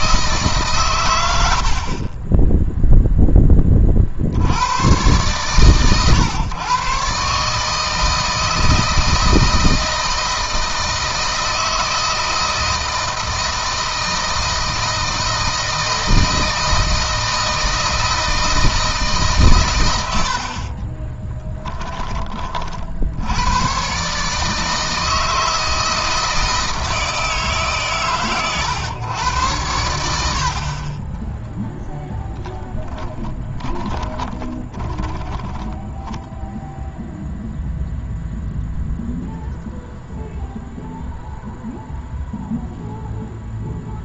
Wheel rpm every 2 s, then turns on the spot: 140, 10, 90, 130, 160, 160, 160, 160, 160, 160, 60, 40, 150, 160, 120, 40, 0, 10, 0, 0, 0, 0.
20-22 34-36